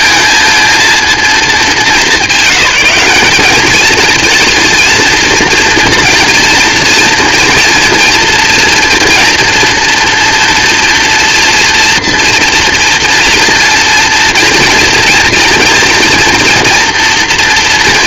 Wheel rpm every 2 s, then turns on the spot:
220, 200, 230, 230, 230, 230, 230, 230, 230.
none